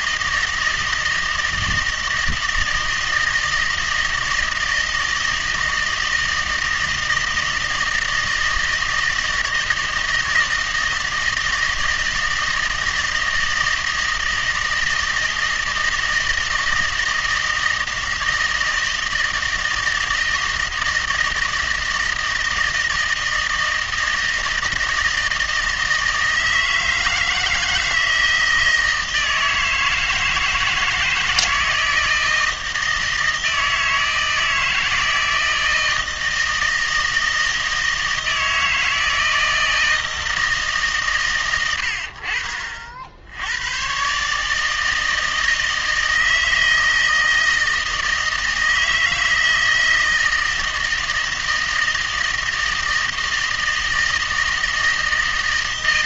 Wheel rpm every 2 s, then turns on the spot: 160, 160, 160, 160, 160, 160, 160, 160, 160, 160, 170, 160, 160, 160, 160, 160, 160, 160, 160, 160, 140, 50, 160, 160, 160, 160, 160, 160.
none